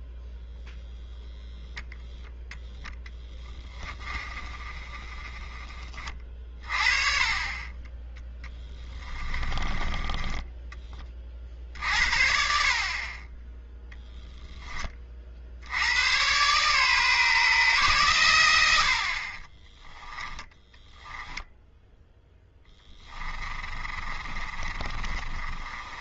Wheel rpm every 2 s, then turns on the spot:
0, 0, 20, 30, 10, 10, 60, 10, 130, 90, 10, 10, 30.
8-10 20-26